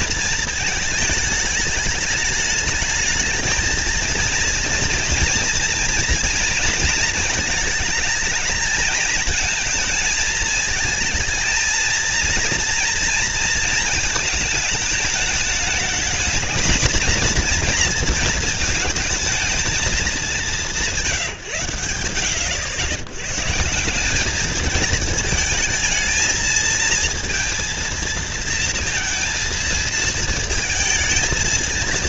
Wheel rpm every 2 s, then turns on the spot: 210, 220, 240, 220, 220, 220, 230, 220, 230, 230, 170, 110, 220, 230, 220, 230.
none